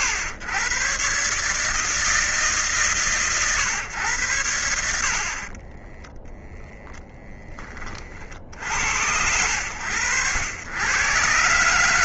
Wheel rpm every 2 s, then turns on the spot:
120, 140, 90, 0, 30, 90.
none